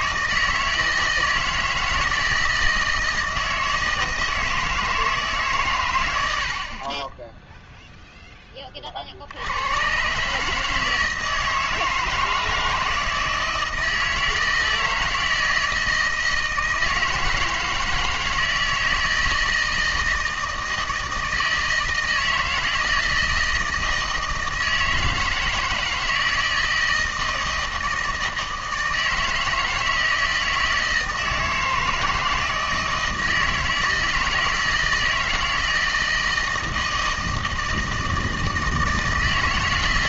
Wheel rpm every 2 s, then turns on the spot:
160, 160, 160, 30, 50, 160, 160, 160, 160, 160, 160, 160, 160, 160, 160, 160, 160, 170, 160, 160.
none